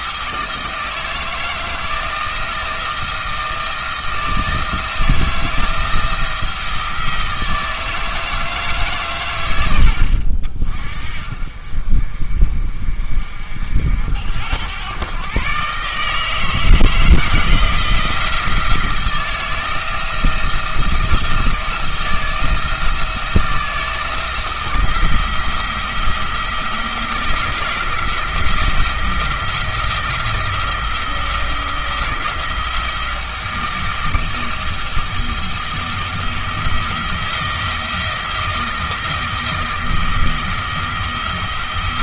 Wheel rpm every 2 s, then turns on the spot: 160, 160, 170, 170, 150, 50, 40, 100, 160, 160, 160, 170, 170, 170, 170, 170, 170, 170, 160, 160, 160.
none